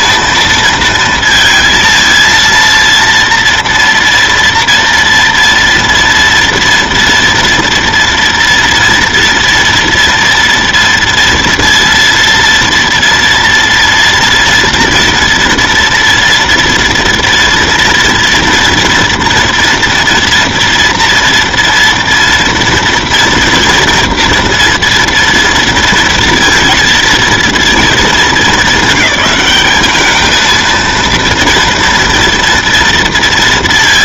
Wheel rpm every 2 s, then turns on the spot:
230, 230, 230, 230, 240, 230, 230, 230, 230, 230, 230, 230, 230, 230, 200, 230, 230.
none